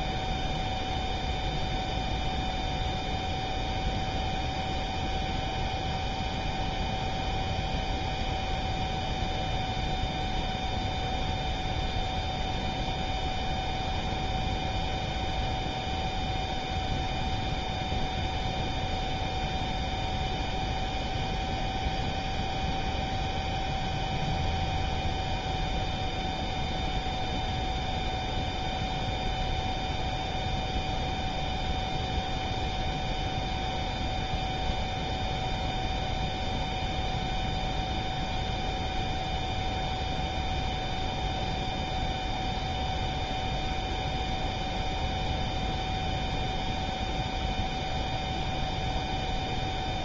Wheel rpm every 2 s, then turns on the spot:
0, 0, 0, 0, 0, 0, 0, 0, 0, 0, 0, 0, 0, 0, 0, 0, 0, 0, 0, 0, 0, 0, 0, 0, 0.
none